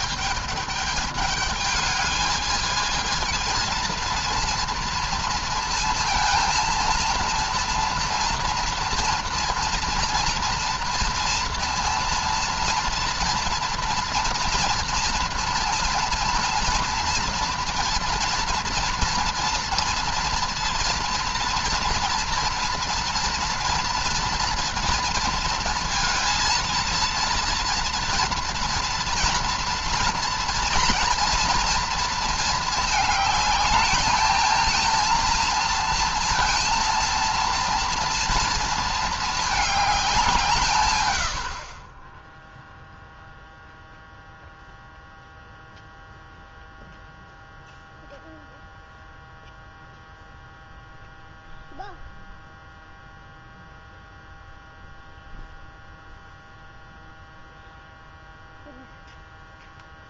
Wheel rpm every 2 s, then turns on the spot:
210, 220, 230, 230, 230, 230, 230, 230, 230, 230, 230, 230, 230, 230, 230, 230, 230, 220, 230, 230, 150, 0, 0, 0, 0, 0, 0, 0, 0, 0.
none